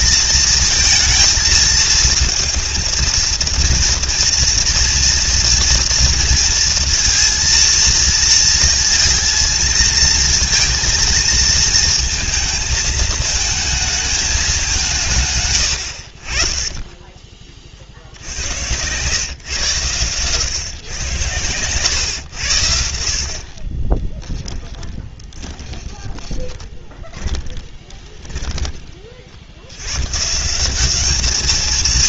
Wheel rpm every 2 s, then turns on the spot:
230, 230, 230, 230, 230, 230, 220, 190, 20, 100, 110, 80, 20, 20, 40, 200.
16-18 24-28